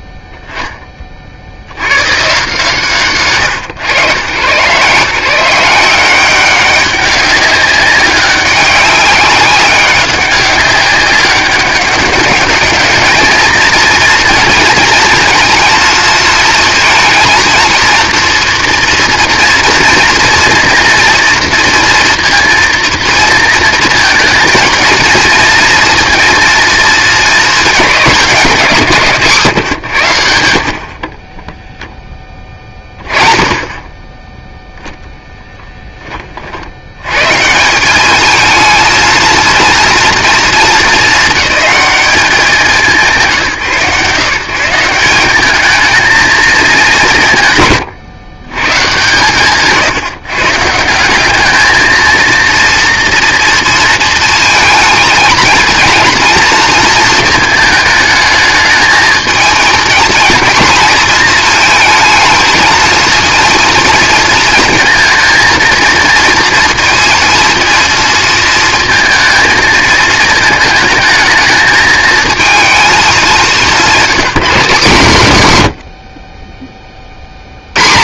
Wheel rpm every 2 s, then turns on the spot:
10, 150, 130, 190, 200, 200, 210, 220, 230, 240, 230, 230, 230, 230, 180, 70, 20, 0, 60, 220, 230, 190, 160, 200, 130, 150, 230, 220, 230, 220, 230, 230, 230, 230, 230, 220, 220, 170, 20.
none